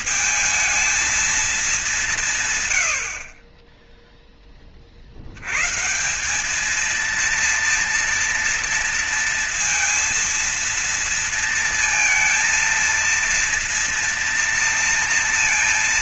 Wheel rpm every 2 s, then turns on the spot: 220, 120, 30, 220, 230, 230, 230, 230.
none